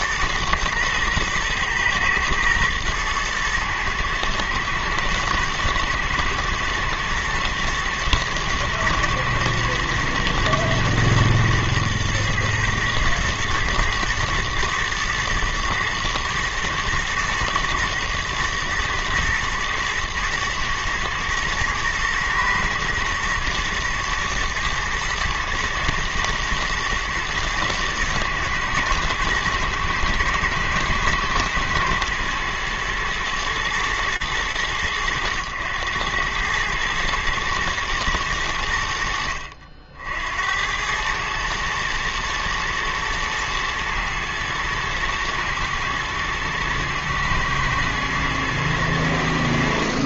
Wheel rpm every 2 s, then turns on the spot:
110, 110, 110, 110, 110, 120, 110, 120, 110, 120, 120, 120, 120, 120, 110, 110, 110, 110, 110, 90, 80, 120, 110, 110, 110.
none